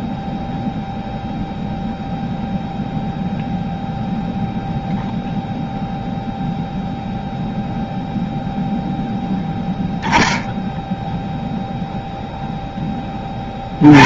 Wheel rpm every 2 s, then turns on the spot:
0, 0, 0, 0, 0, 0, 10.
none